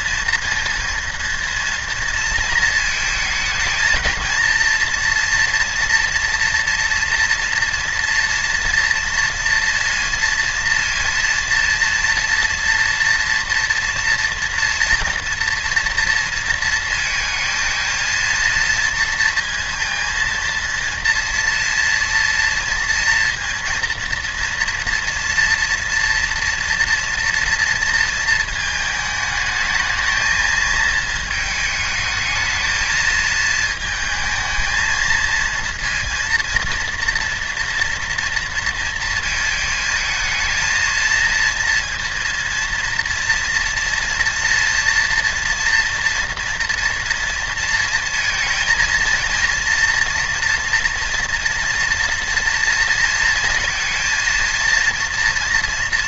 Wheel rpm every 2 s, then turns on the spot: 230, 220, 230, 230, 230, 230, 230, 240, 230, 230, 230, 230, 230, 240, 220, 220, 220, 220, 230, 230, 220, 230, 230, 230, 220, 240, 230, 230.
none